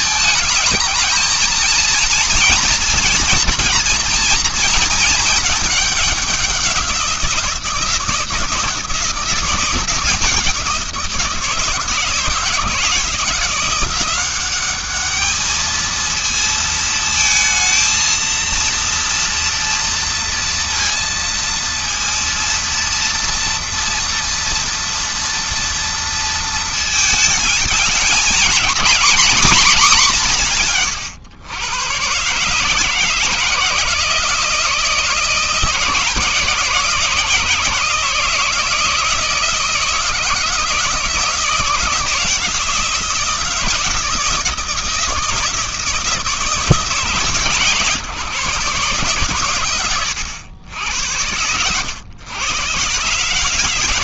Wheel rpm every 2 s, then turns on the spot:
220, 230, 230, 190, 170, 170, 170, 200, 230, 230, 230, 230, 230, 230, 230, 140, 150, 160, 150, 160, 160, 170, 170, 160, 140, 90, 120.
none